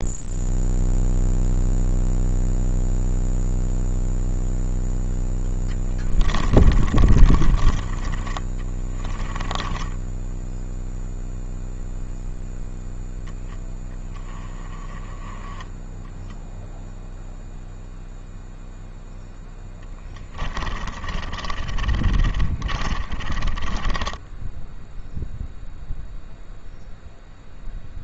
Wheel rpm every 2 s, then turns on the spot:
0, 0, 0, 30, 20, 0, 0, 20, 0, 0, 30, 30, 0, 0.
6-8 20-24